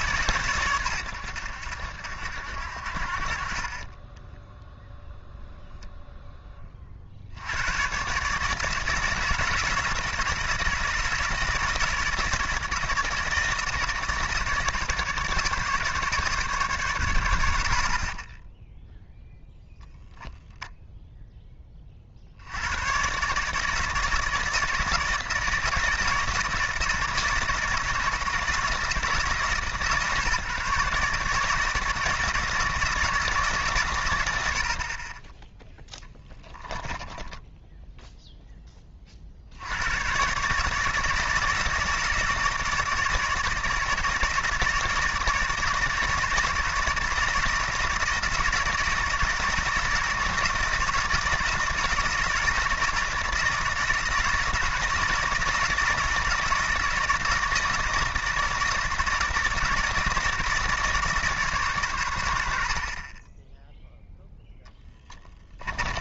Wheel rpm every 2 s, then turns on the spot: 130, 70, 10, 20, 160, 160, 160, 160, 140, 10, 0, 90, 160, 160, 160, 140, 160, 70, 10, 10, 140, 160, 160, 160, 160, 160, 160, 160, 160, 160, 160, 60, 10.
4-6 18-20 36-38